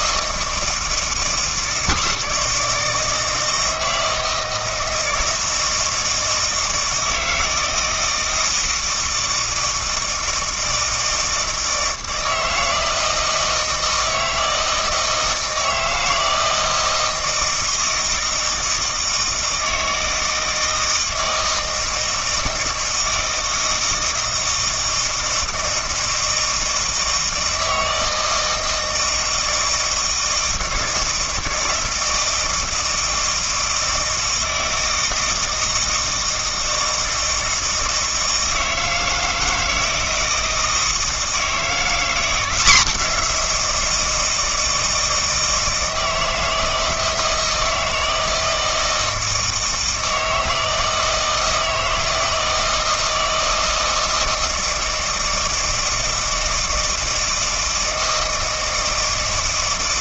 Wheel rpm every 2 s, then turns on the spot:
160, 160, 160, 160, 160, 160, 160, 160, 160, 160, 160, 160, 160, 160, 160, 160, 160, 160, 160, 160, 160, 180, 160, 160, 160, 160, 160, 160, 160, 160.
none